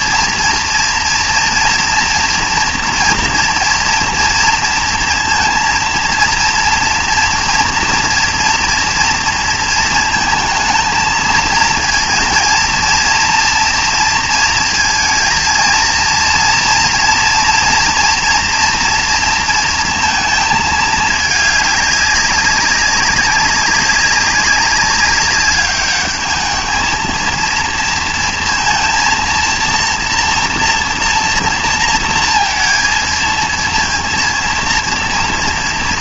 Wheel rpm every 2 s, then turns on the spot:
230, 230, 230, 230, 230, 220, 230, 230, 230, 230, 220, 200, 190, 220, 230, 240, 230, 230.
none